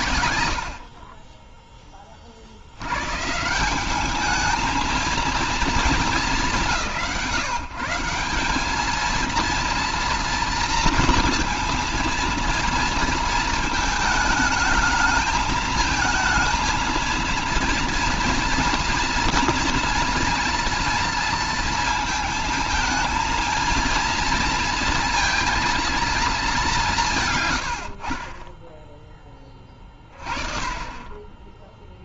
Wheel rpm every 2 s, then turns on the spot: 90, 30, 210, 210, 180, 230, 230, 220, 220, 230, 230, 230, 220, 210, 40, 30.
none